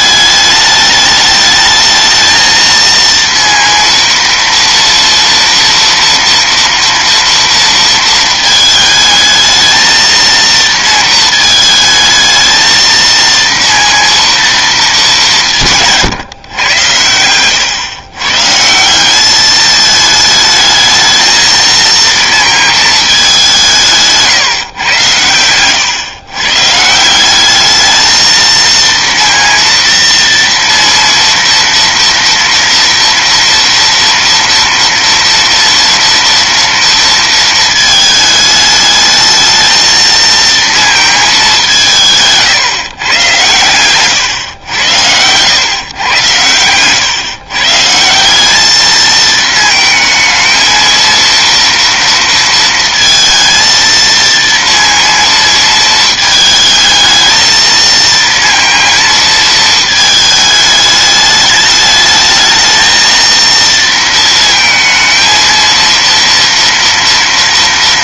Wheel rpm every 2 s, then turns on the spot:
210, 230, 230, 230, 220, 230, 230, 230, 120, 160, 220, 230, 140, 140, 230, 230, 230, 230, 230, 210, 230, 150, 110, 110, 200, 220, 230, 230, 220, 230, 210, 220, 220, 230.
none